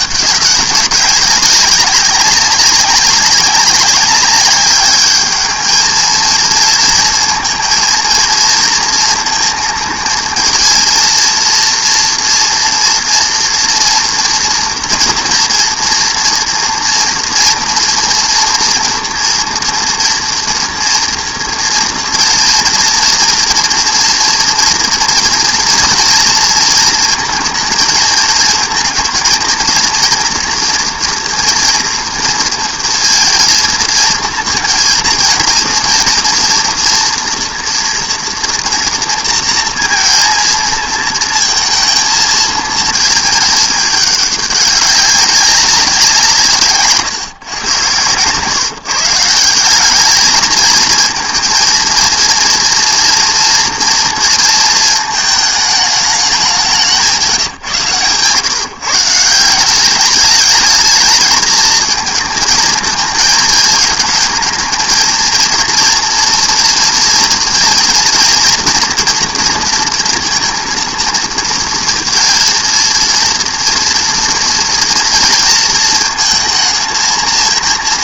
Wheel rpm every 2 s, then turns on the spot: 200, 200, 200, 230, 230, 230, 240, 230, 230, 230, 230, 230, 240, 230, 220, 230, 230, 230, 230, 230, 230, 220, 200, 150, 130, 220, 230, 230, 190, 140, 220, 230, 230, 230, 240, 230, 230, 230, 220.
none